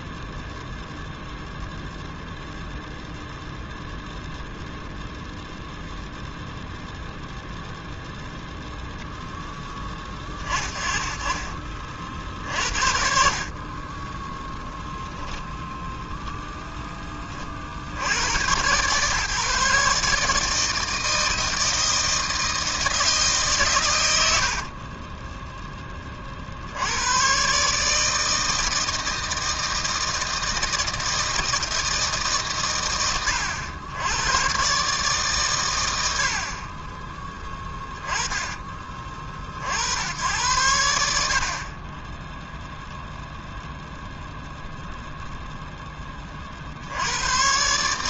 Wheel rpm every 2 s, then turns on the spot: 0, 0, 0, 0, 0, 30, 50, 0, 10, 130, 160, 160, 30, 80, 160, 160, 120, 140, 30, 30, 80, 0, 0, 70.
24-26